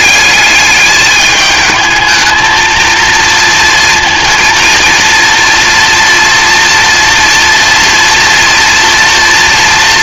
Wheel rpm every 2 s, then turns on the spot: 210, 230, 230, 230, 230.
none